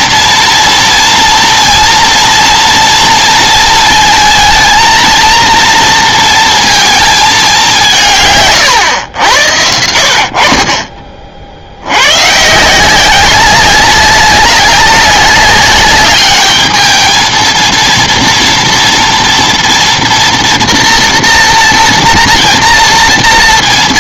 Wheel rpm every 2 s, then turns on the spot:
230, 230, 230, 230, 140, 60, 150, 200, 210, 230, 230, 230.
none